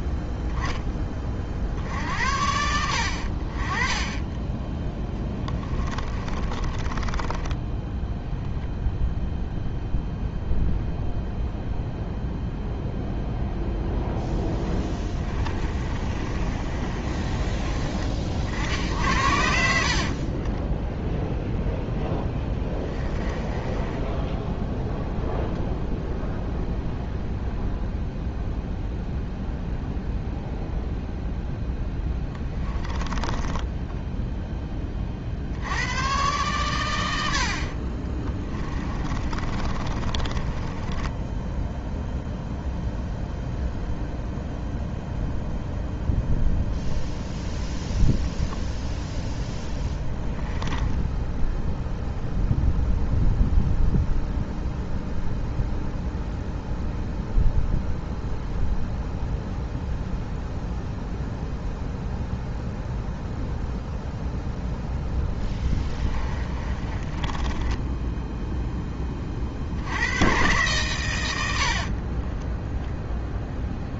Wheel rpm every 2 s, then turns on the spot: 20, 70, 10, 30, 0, 0, 0, 20, 30, 70, 10, 20, 0, 0, 0, 0, 20, 20, 100, 20, 20, 0, 0, 0, 0, 10, 0, 0, 0, 0, 0, 0, 0, 20, 10, 120, 0.
6-8 14-20 22-24 32-34 38-42 50-52 66-68